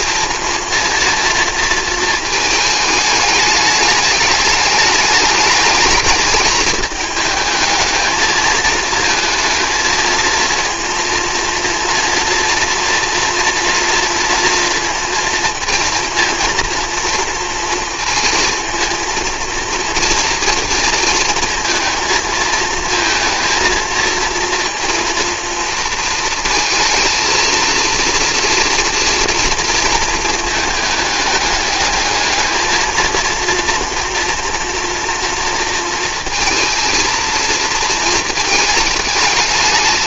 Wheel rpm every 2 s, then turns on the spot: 230, 220, 210, 220, 220, 230, 230, 230, 230, 230, 230, 230, 230, 230, 230, 220, 220, 230, 230, 220.
none